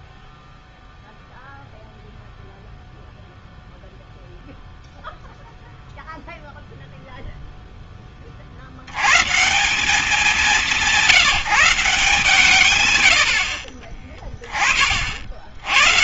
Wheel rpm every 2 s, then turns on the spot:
0, 0, 0, 0, 110, 180, 140, 40.
none